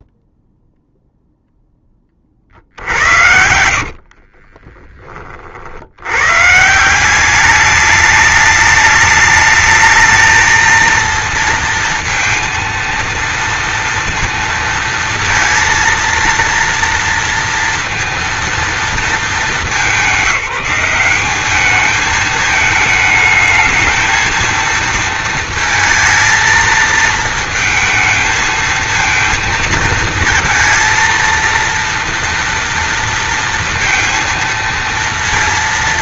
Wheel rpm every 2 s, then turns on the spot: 0, 70, 30, 180, 210, 230, 230, 230, 230, 210, 190, 220, 230, 220, 220, 230, 230, 230.
2-4